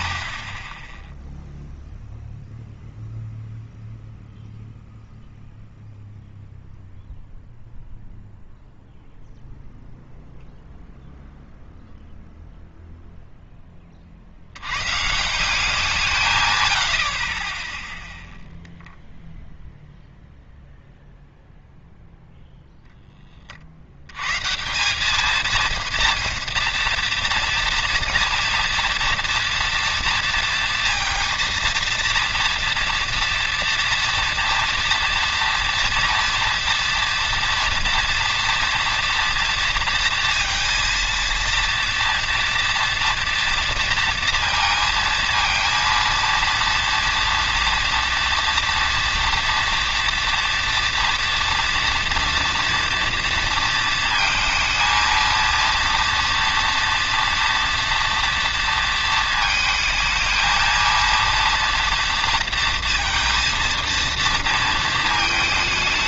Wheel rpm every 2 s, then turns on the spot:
40, 0, 0, 0, 0, 0, 0, 50, 160, 0, 0, 0, 140, 230, 240, 230, 230, 230, 230, 230, 230, 230, 230, 230, 240, 230, 230, 230, 230, 230, 220, 230, 230.
none